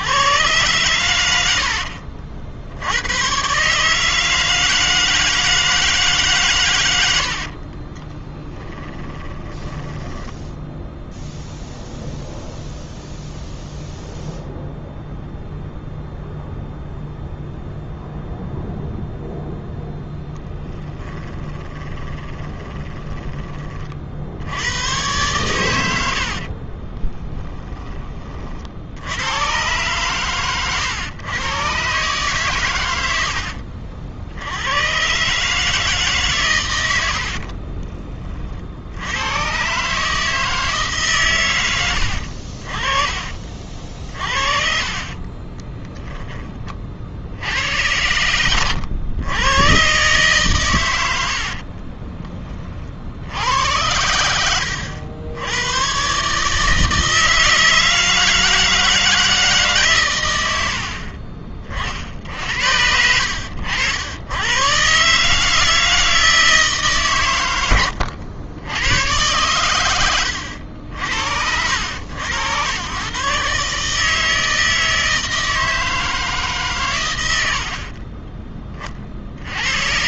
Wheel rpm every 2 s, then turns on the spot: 110, 90, 160, 100, 10, 0, 0, 0, 0, 0, 10, 20, 110, 20, 70, 110, 100, 110, 90, 90, 150, 40, 40, 30, 110, 100, 40, 80, 160, 160, 60, 80, 130, 150, 100, 80, 100, 160, 120, 40.
6-10 22-24 26-28 44-46 60-62